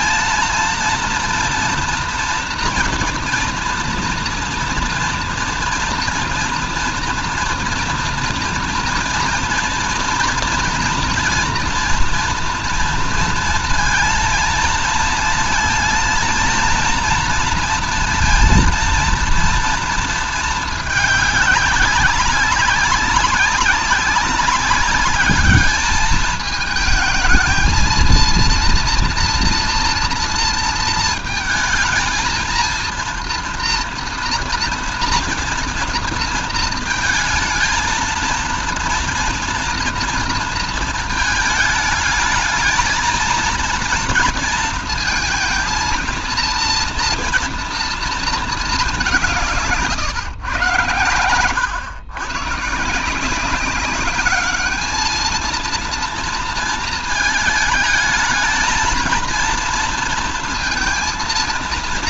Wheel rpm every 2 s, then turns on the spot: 230, 230, 230, 240, 240, 230, 230, 230, 230, 230, 220, 190, 190, 220, 230, 230, 230, 240, 230, 230, 230, 220, 230, 230, 210, 110, 140, 210, 220, 220, 230.
none